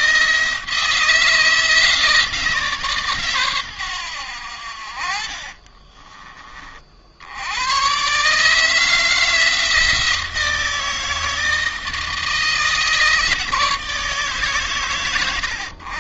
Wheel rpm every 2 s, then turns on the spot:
160, 140, 50, 50, 160, 160, 160, 120.
4-6